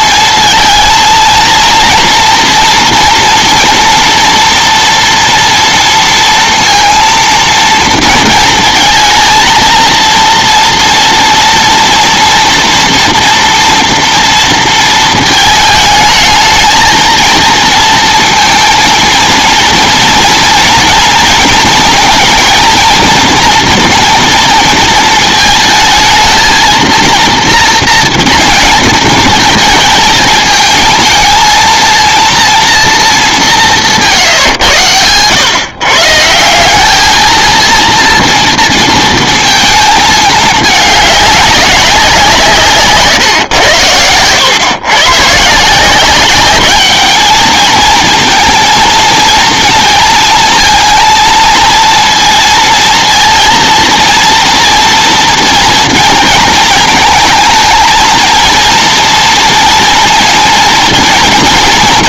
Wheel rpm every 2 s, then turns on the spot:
230, 230, 230, 230, 230, 230, 240, 230, 220, 230, 240, 230, 230, 230, 220, 220, 230, 110, 200, 230, 210, 140, 120, 210, 230, 230, 230, 230, 220, 230, 230.
none